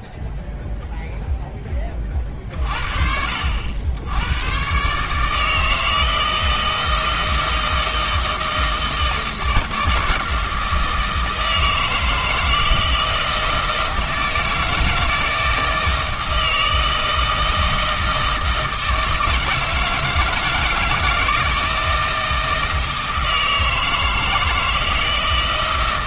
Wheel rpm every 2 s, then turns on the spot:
0, 40, 130, 160, 160, 160, 160, 160, 160, 160, 160, 160, 160.
none